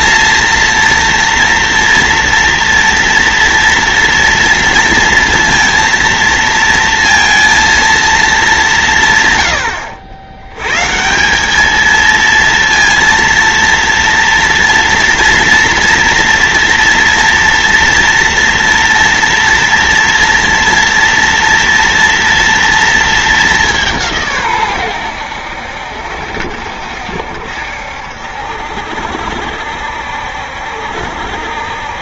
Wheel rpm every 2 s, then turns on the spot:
230, 240, 230, 230, 200, 110, 230, 240, 240, 230, 230, 230, 130, 60, 70, 70.
none